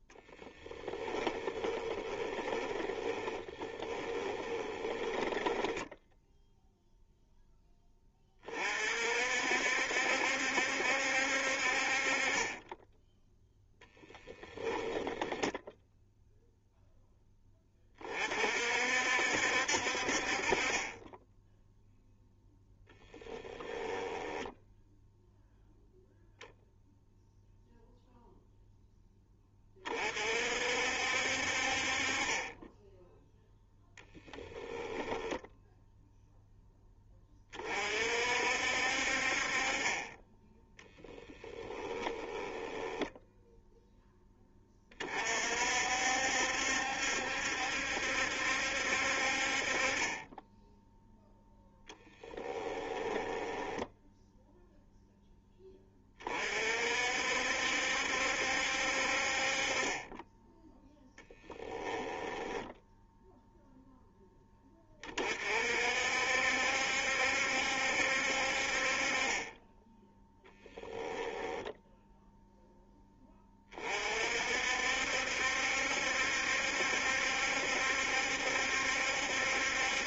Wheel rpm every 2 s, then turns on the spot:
20, 20, 20, 0, 50, 70, 10, 10, 0, 60, 30, 0, 0, 0, 10, 60, 10, 0, 10, 60, 20, 20, 30, 70, 60, 0, 10, 0, 50, 60, 10, 10, 20, 70, 40, 10, 10, 60, 70, 70.
0-6 40-44 52-54 60-64 70-72